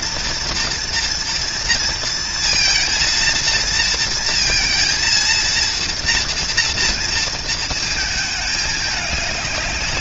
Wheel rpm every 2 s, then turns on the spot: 240, 230, 230, 230, 210.
none